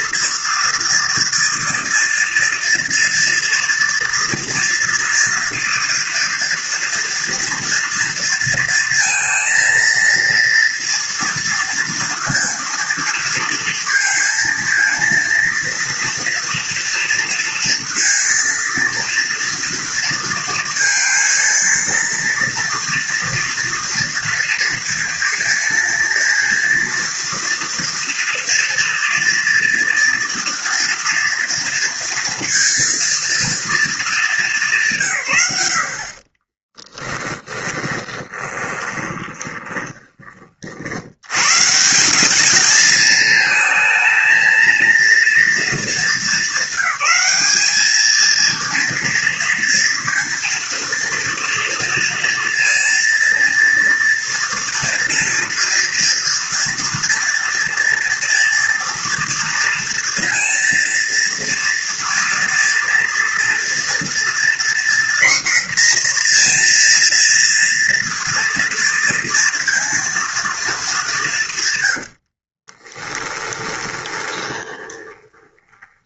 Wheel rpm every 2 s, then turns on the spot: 230, 230, 230, 230, 230, 230, 230, 230, 230, 230, 230, 230, 230, 230, 230, 230, 230, 140, 10, 20, 100, 220, 230, 200, 230, 230, 230, 230, 230, 230, 230, 230, 250, 230, 230, 190, 10, 20.
36-40 72-76